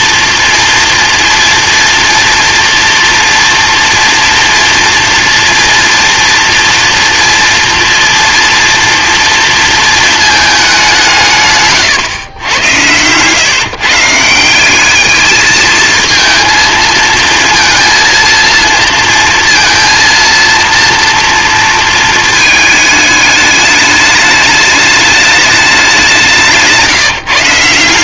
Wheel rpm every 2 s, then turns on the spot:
230, 240, 230, 230, 230, 210, 110, 190, 230, 230, 230, 220, 210, 170.
none